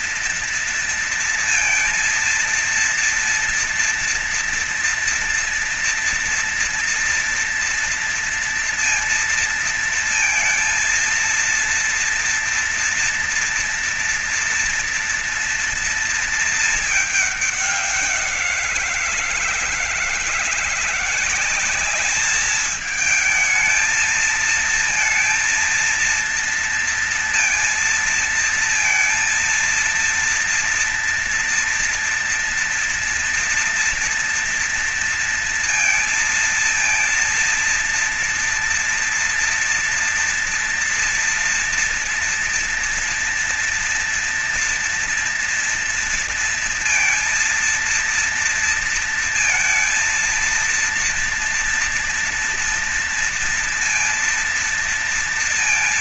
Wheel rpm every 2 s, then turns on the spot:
230, 230, 230, 230, 230, 230, 230, 230, 230, 190, 160, 210, 220, 230, 230, 230, 230, 230, 230, 230, 230, 240, 230, 230, 230, 230, 230, 230.
none